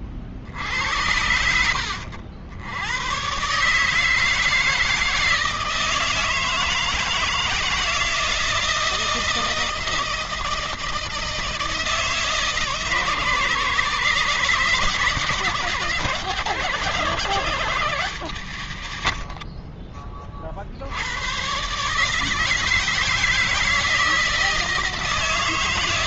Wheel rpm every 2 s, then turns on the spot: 80, 80, 160, 160, 160, 160, 160, 150, 160, 160, 30, 160, 160.
none